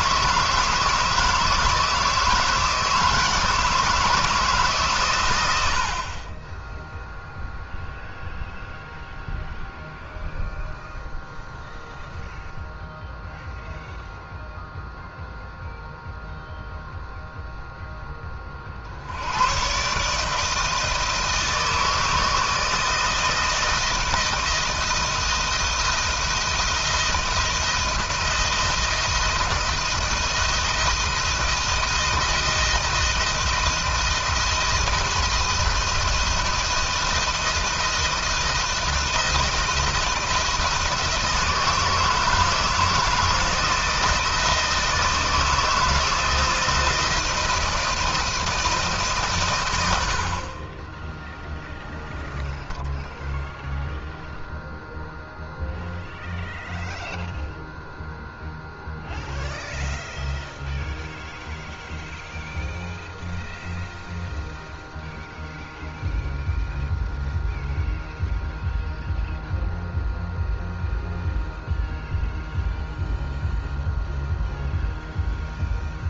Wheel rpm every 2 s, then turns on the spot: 160, 160, 150, 10, 0, 0, 0, 0, 0, 40, 160, 160, 170, 160, 170, 170, 160, 160, 170, 170, 160, 160, 160, 160, 160, 40, 0, 0, 0, 0, 0, 0, 0, 0, 0, 0, 0, 0.
none